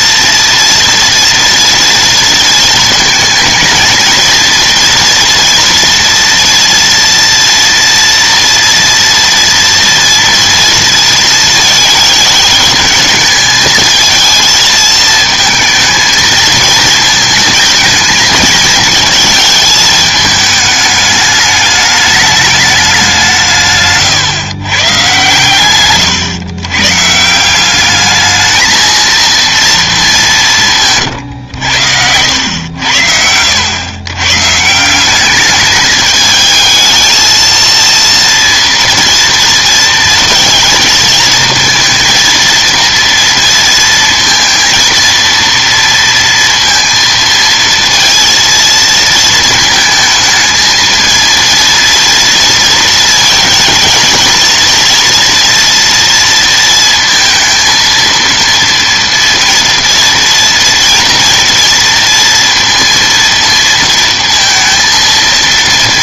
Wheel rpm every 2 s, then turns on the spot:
230, 230, 230, 230, 230, 230, 210, 220, 230, 230, 220, 210, 130, 120, 220, 170, 100, 160, 220, 230, 230, 230, 230, 230, 230, 220, 230, 230, 230, 230, 240, 230, 230.
none